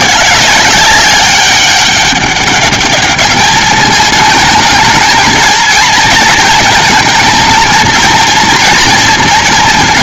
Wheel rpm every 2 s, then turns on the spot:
200, 200, 220, 230, 230.
none